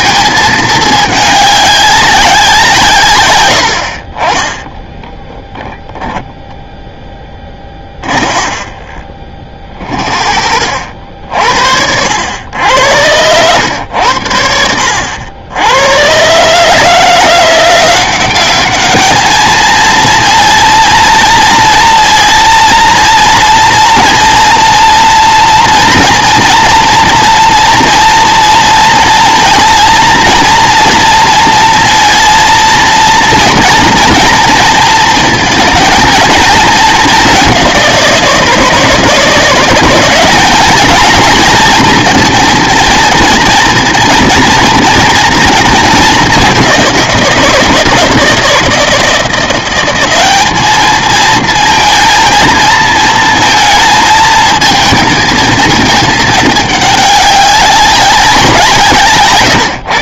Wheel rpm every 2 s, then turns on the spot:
220, 170, 10, 0, 30, 70, 90, 70, 140, 210, 230, 230, 230, 230, 230, 230, 230, 230, 220, 160, 210, 230, 230, 190, 160, 210, 230, 220, 210, 170.
8-10